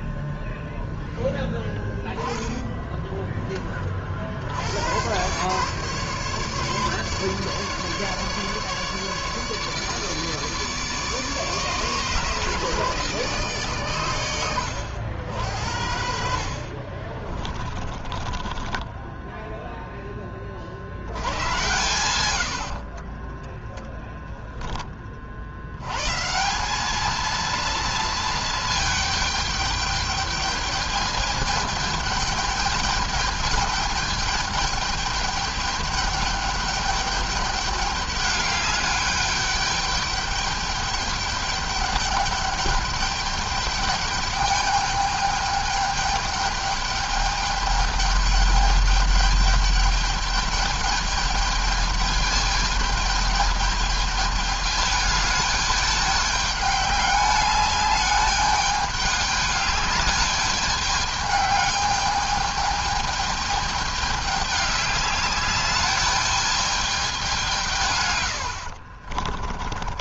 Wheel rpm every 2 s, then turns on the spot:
10, 10, 90, 150, 150, 150, 150, 90, 40, 10, 60, 50, 30, 200, 220, 210, 210, 210, 210, 210, 210, 210, 210, 210, 210, 210, 210, 210, 200, 200, 210, 210, 200, 200, 50.
16-20 22-24 68-70